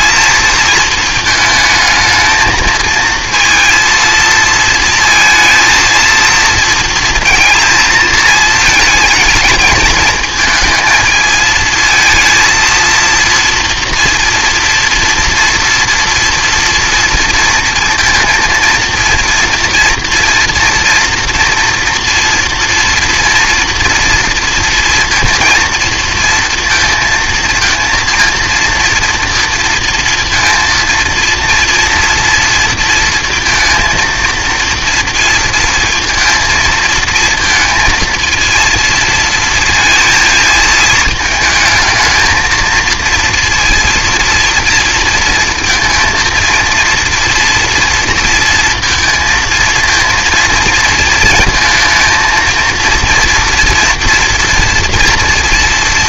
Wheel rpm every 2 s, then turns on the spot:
220, 220, 230, 230, 220, 220, 230, 230, 230, 240, 230, 230, 230, 230, 230, 230, 230, 230, 230, 230, 220, 220, 230, 230, 230, 230, 230, 230.
none